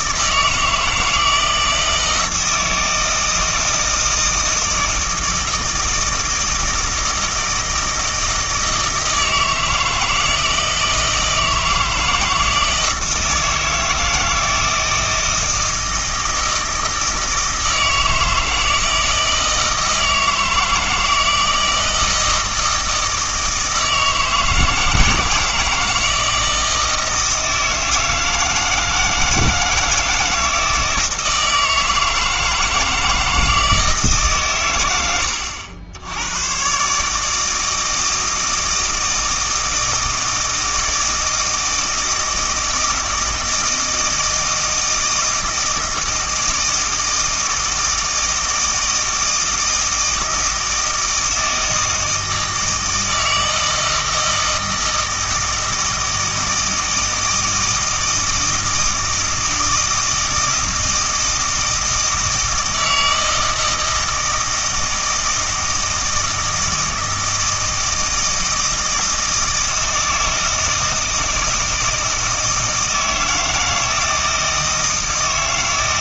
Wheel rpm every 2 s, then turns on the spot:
160, 160, 160, 160, 160, 160, 160, 160, 160, 160, 160, 160, 160, 160, 160, 160, 160, 110, 130, 160, 160, 160, 160, 160, 160, 160, 160, 160, 160, 160, 160, 160, 160, 160, 160, 160, 160, 160.
none